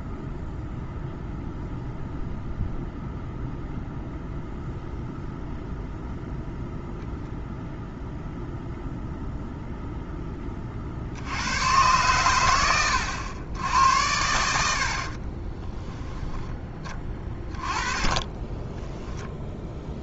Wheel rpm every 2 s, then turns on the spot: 0, 0, 0, 0, 0, 50, 100, 60, 10, 10.
18-20